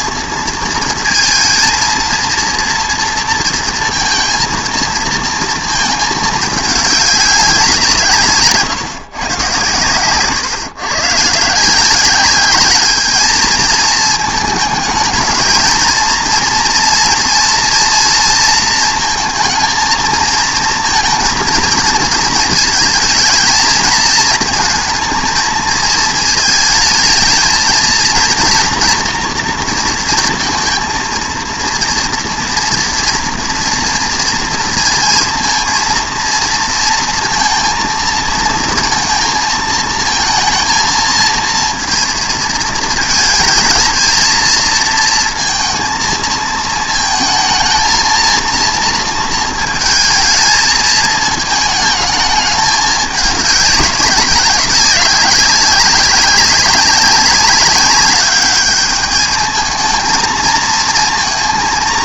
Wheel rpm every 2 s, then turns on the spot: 230, 230, 230, 200, 140, 130, 210, 210, 230, 220, 230, 230, 220, 220, 240, 230, 240, 230, 230, 230, 220, 220, 230, 230, 230, 220, 200, 190, 200, 210, 230.
none